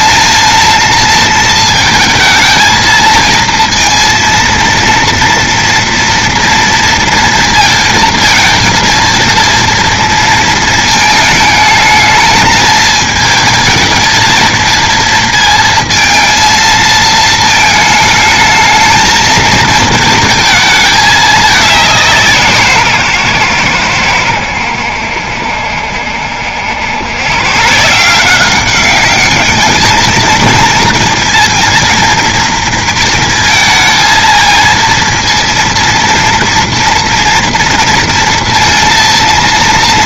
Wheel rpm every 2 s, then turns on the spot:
230, 220, 230, 230, 230, 230, 220, 230, 230, 220, 220, 160, 90, 80, 190, 230, 230, 230, 230, 230.
none